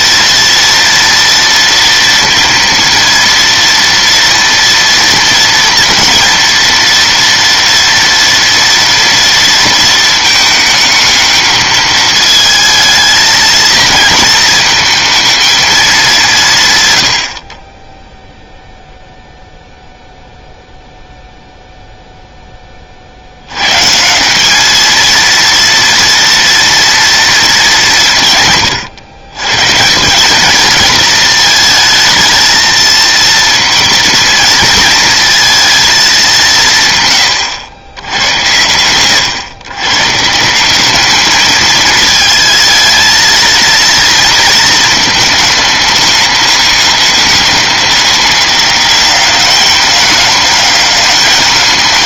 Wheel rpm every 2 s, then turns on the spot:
230, 230, 240, 230, 230, 220, 220, 230, 200, 0, 0, 10, 200, 230, 150, 210, 230, 230, 180, 100, 170, 220, 230, 210, 200, 210.
none